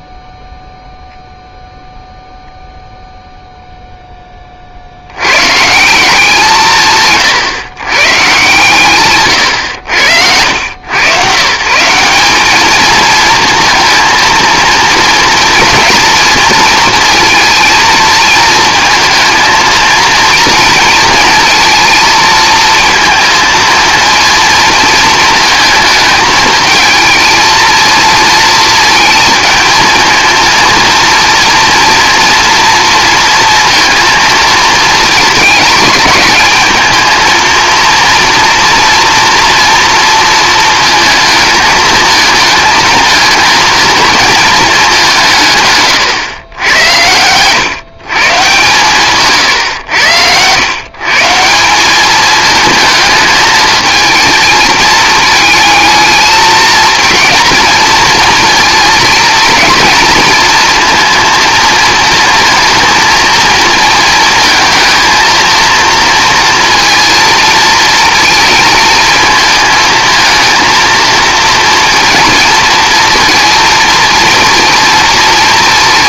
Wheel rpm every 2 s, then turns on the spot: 0, 0, 80, 140, 130, 120, 230, 230, 230, 230, 230, 230, 220, 220, 230, 230, 230, 220, 220, 230, 220, 220, 180, 100, 140, 140, 220, 220, 230, 230, 230, 230, 220, 230, 220, 230, 230, 230.
8-10